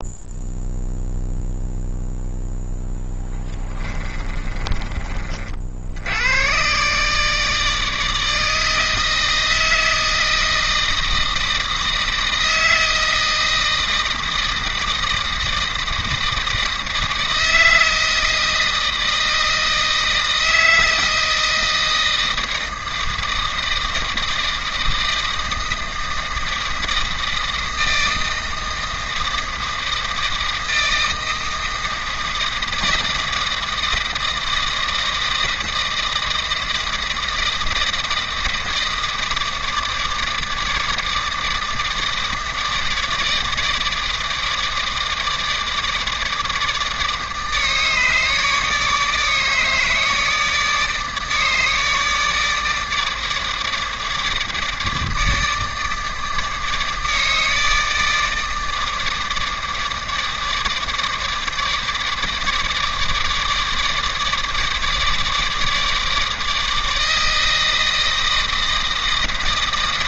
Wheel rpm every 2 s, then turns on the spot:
0, 10, 30, 130, 160, 160, 160, 160, 160, 160, 160, 160, 160, 160, 160, 160, 160, 160, 160, 160, 160, 160, 160, 160, 150, 160, 150, 150, 150, 160, 160, 150, 150, 160, 160.
4-6